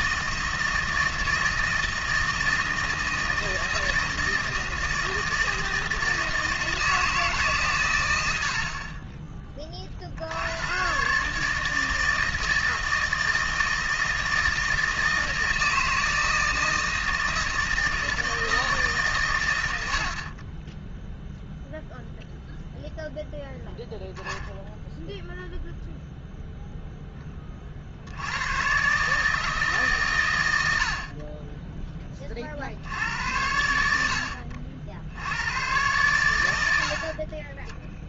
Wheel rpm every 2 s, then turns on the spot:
160, 160, 160, 160, 60, 120, 160, 160, 160, 150, 20, 0, 0, 10, 140, 70, 70, 70, 80.
none